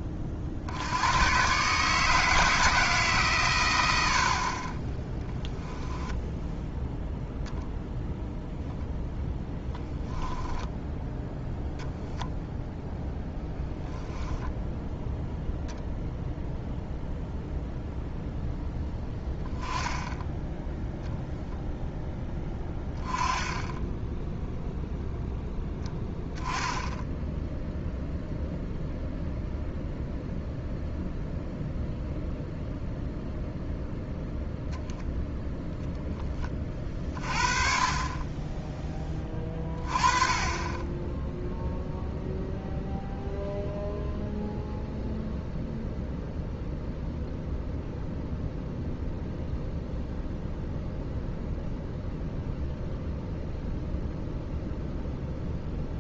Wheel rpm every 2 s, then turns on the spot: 50, 160, 30, 0, 0, 10, 0, 0, 0, 0, 0, 10, 0, 10, 0, 0, 0, 0, 30, 10, 20, 0, 0, 0, 0, 0, 0, 0.
4-6